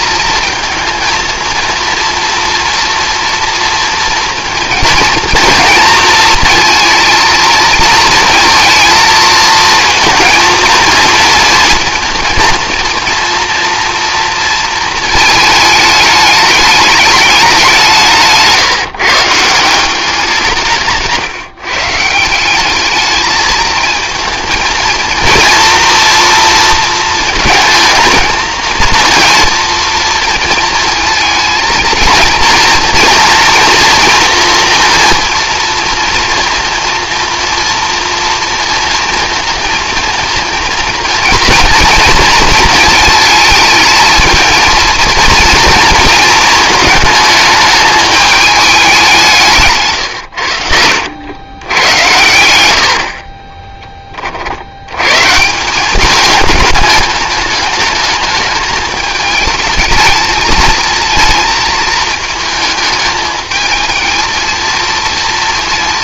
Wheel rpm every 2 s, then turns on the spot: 220, 230, 230, 230, 230, 230, 230, 230, 210, 150, 170, 200, 230, 230, 230, 230, 230, 230, 230, 230, 230, 220, 230, 220, 210, 100, 80, 80, 220, 210, 220, 220, 230.
none